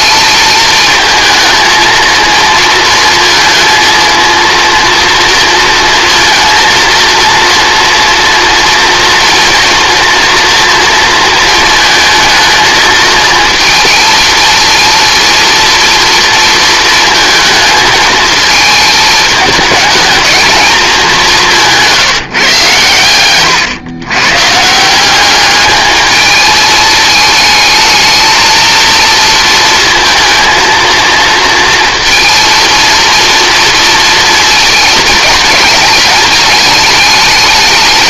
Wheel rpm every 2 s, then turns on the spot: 220, 220, 230, 230, 230, 230, 220, 230, 230, 220, 220, 150, 140, 220, 230, 230, 230, 220, 210.
none